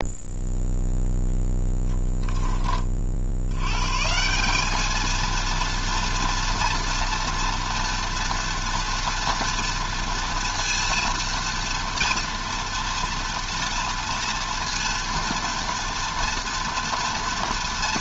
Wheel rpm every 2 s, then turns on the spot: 0, 30, 210, 230, 240, 230, 230, 230, 230.
none